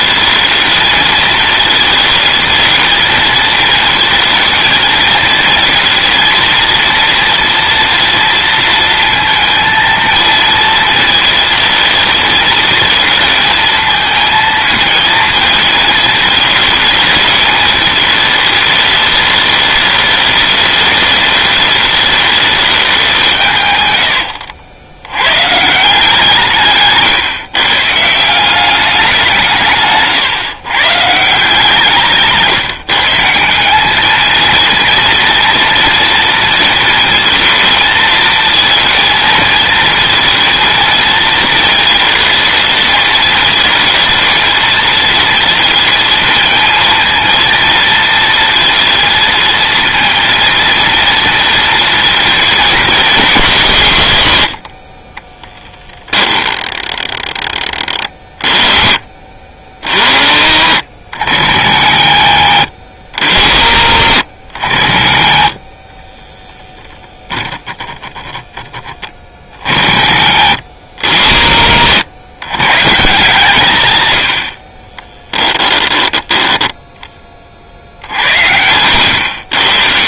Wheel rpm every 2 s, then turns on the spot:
230, 230, 220, 230, 230, 220, 220, 220, 220, 210, 210, 190, 90, 130, 190, 140, 150, 230, 230, 230, 230, 220, 230, 220, 230, 230, 230, 40, 10, 30, 60, 90, 50, 0, 20, 80, 140, 40, 10, 100.
54-56 74-76